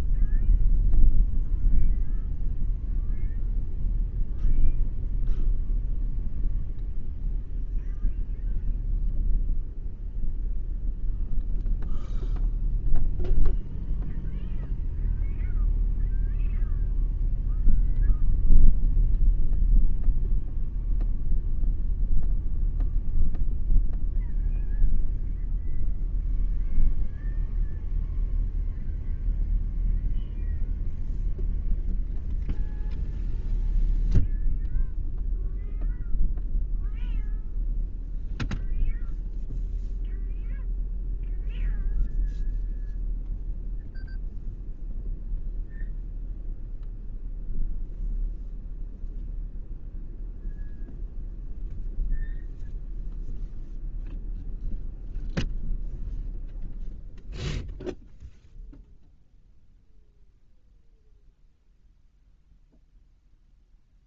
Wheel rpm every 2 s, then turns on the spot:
0, 0, 0, 0, 0, 0, 0, 0, 0, 0, 0, 0, 0, 0, 0, 0, 0, 0, 0, 0, 0, 0, 0, 0, 0, 0, 0, 0, 0, 0, 0, 0.
none